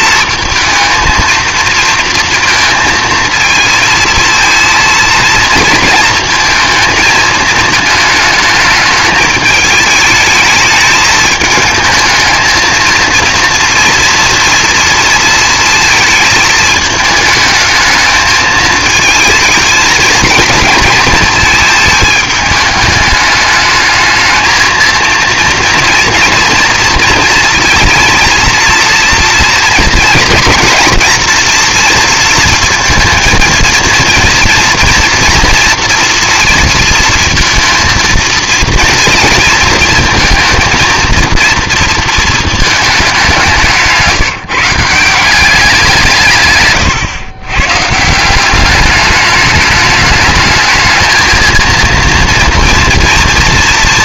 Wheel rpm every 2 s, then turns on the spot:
220, 230, 220, 220, 210, 220, 230, 230, 220, 220, 220, 210, 230, 230, 230, 230, 230, 230, 230, 230, 230, 210, 180, 120, 200, 220, 230.
none